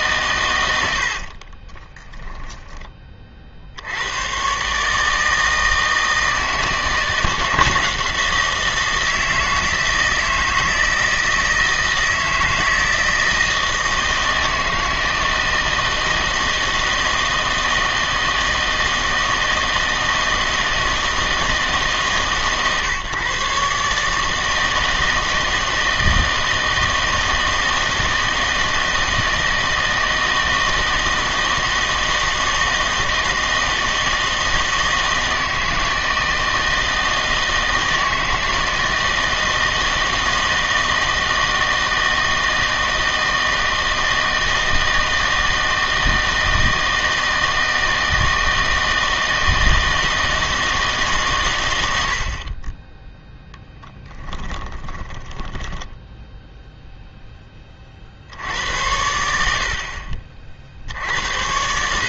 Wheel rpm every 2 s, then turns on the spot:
90, 10, 140, 160, 160, 160, 160, 160, 160, 160, 160, 140, 160, 160, 160, 160, 160, 160, 160, 160, 160, 160, 160, 160, 160, 160, 20, 20, 0, 80, 60.
54-56